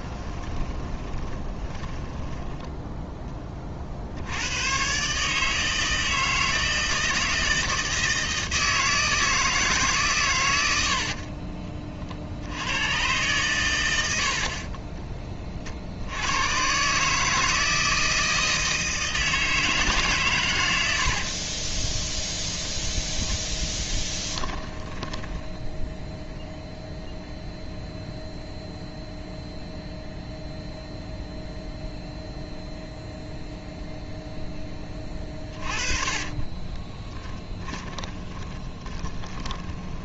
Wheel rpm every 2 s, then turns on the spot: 20, 10, 110, 160, 160, 80, 110, 30, 130, 160, 100, 10, 10, 0, 0, 0, 0, 20, 30, 20.
0-2 14-16 20-22 24-26 36-40